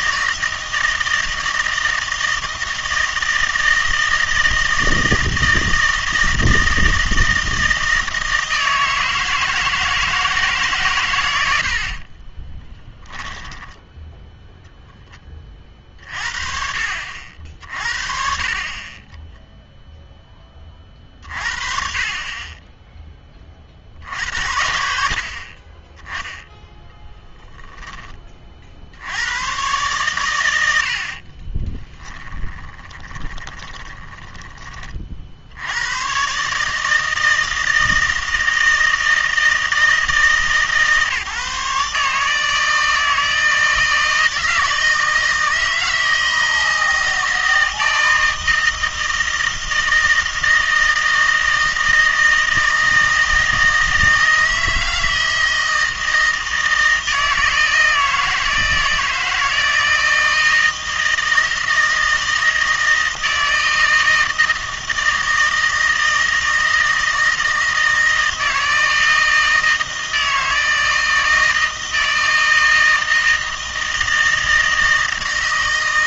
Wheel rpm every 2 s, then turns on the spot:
160, 160, 160, 160, 160, 140, 10, 0, 50, 40, 30, 20, 60, 10, 50, 70, 10, 30, 150, 160, 150, 160, 160, 160, 160, 160, 160, 160, 160, 160, 160, 160, 160, 160, 160, 160, 160, 160.
12-14 32-34